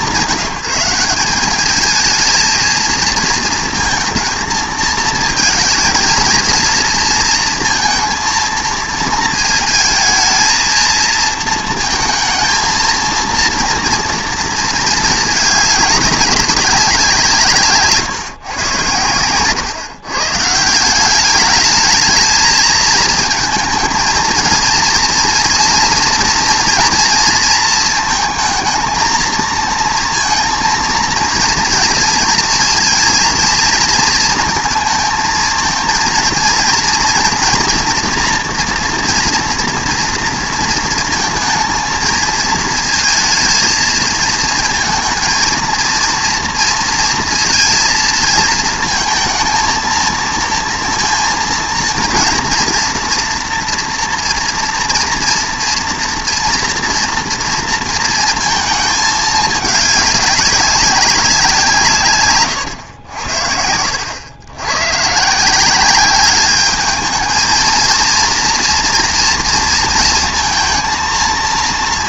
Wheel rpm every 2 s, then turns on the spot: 170, 230, 220, 220, 230, 220, 230, 220, 190, 110, 160, 220, 230, 240, 220, 230, 230, 220, 230, 230, 230, 220, 230, 230, 220, 230, 230, 230, 230, 220, 200, 110, 120, 210, 230, 230.
none